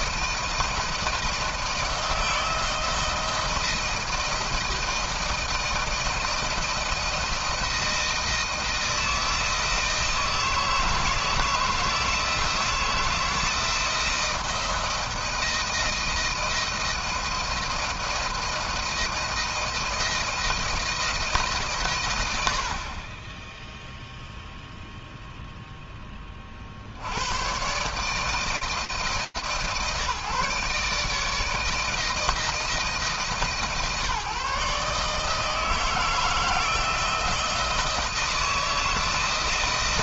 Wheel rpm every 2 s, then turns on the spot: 170, 170, 160, 170, 160, 160, 160, 170, 170, 170, 170, 50, 0, 60, 160, 150, 160, 150, 170, 170.
none